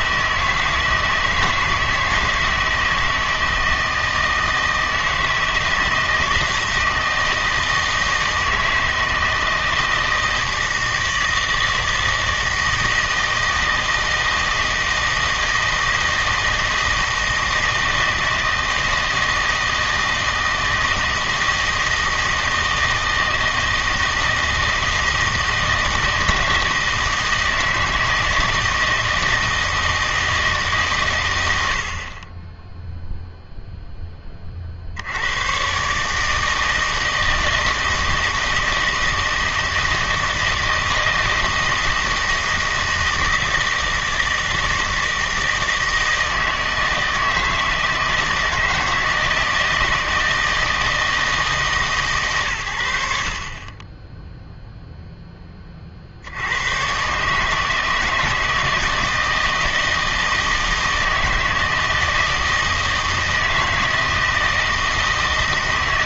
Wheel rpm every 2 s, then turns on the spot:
160, 160, 160, 160, 160, 160, 160, 160, 160, 160, 160, 160, 160, 160, 160, 140, 0, 60, 160, 160, 160, 160, 160, 160, 160, 160, 110, 0, 110, 160, 160, 160, 160.
none